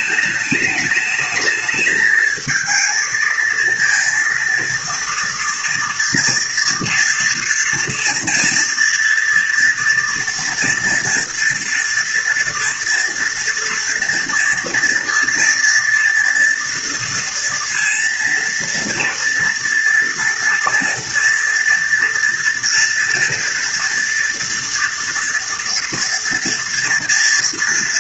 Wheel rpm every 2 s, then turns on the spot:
210, 230, 230, 230, 230, 230, 230, 230, 230, 230, 230, 230, 230, 230.
none